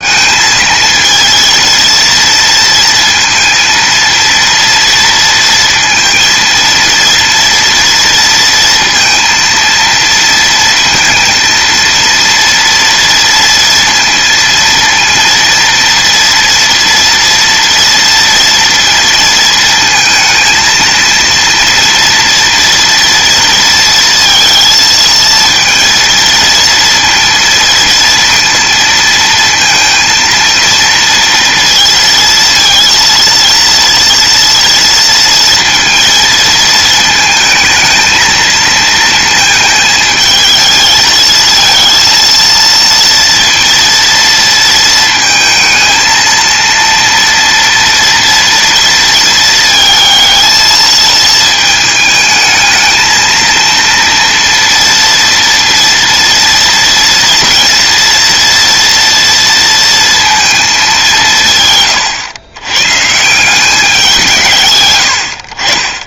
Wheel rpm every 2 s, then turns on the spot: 230, 230, 230, 230, 230, 230, 230, 230, 230, 230, 230, 230, 230, 230, 230, 230, 230, 230, 220, 220, 220, 230, 230, 230, 230, 220, 220, 230, 230, 230, 180, 150, 100.
none